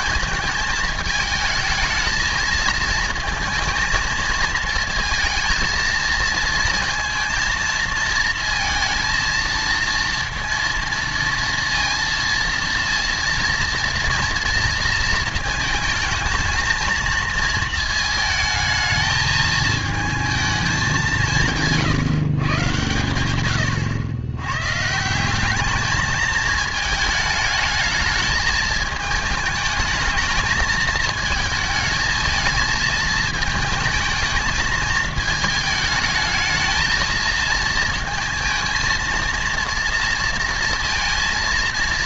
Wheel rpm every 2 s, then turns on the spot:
190, 220, 220, 230, 230, 230, 230, 230, 220, 220, 220, 120, 110, 220, 210, 220, 220, 220, 220, 230, 230.
none